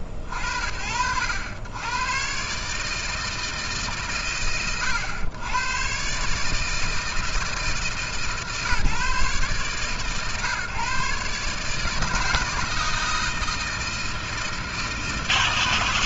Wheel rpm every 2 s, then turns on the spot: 40, 140, 110, 140, 140, 130, 160, 160.
none